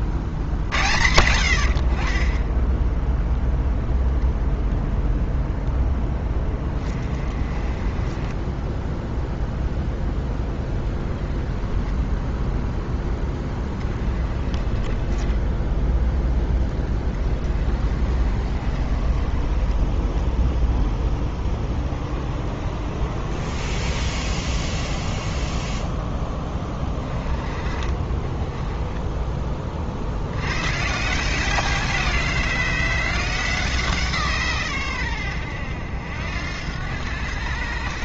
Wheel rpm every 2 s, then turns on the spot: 70, 0, 0, 20, 10, 10, 10, 20, 20, 30, 0, 40, 10, 20, 10, 130, 170, 110, 90.
6-10